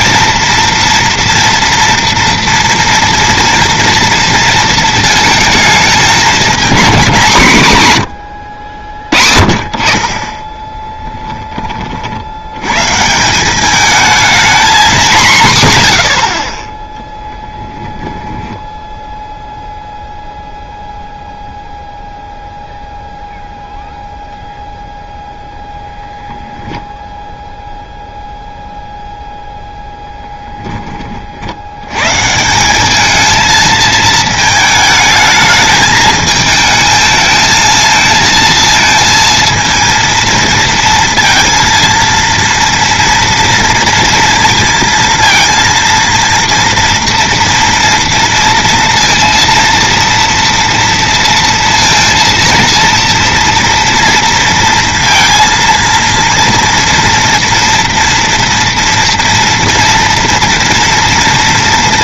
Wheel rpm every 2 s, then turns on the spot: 230, 230, 230, 220, 80, 20, 110, 220, 30, 10, 0, 0, 0, 20, 0, 10, 170, 220, 220, 230, 230, 230, 230, 240, 230, 230, 230, 230, 230, 230, 230.
18-20